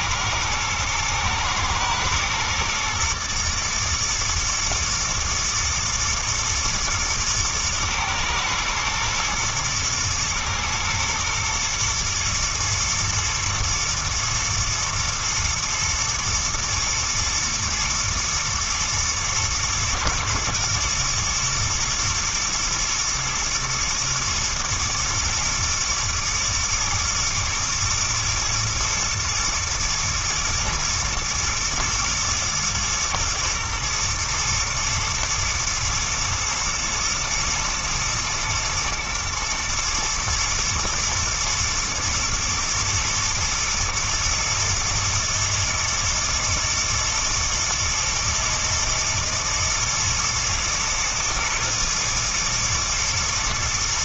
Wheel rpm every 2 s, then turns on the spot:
110, 120, 120, 110, 120, 110, 110, 120, 120, 110, 120, 110, 110, 110, 110, 110, 110, 120, 120, 110, 110, 120, 120, 120, 120, 110, 120.
none